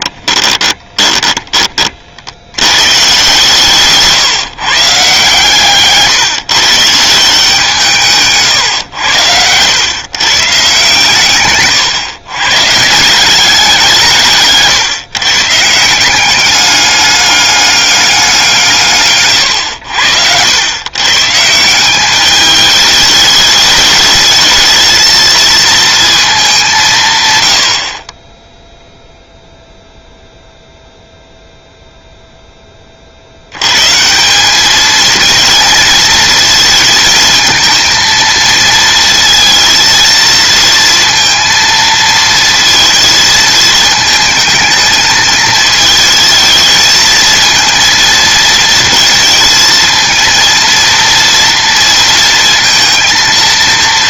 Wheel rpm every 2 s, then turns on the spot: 20, 110, 140, 160, 110, 140, 160, 140, 200, 150, 130, 210, 220, 170, 0, 0, 30, 220, 220, 230, 230, 220, 220, 220, 230, 230, 230.
0-2